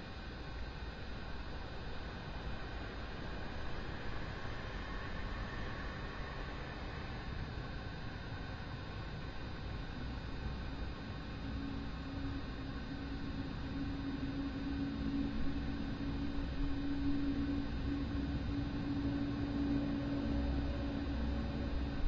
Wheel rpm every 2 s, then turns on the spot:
0, 0, 0, 0, 0, 0, 0, 0, 0, 0, 0.
none